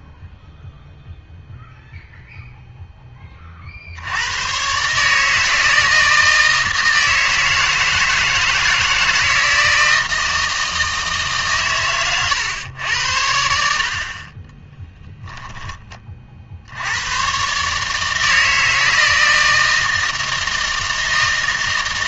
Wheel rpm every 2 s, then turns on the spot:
0, 0, 130, 160, 160, 160, 90, 10, 80, 160, 160.
14-16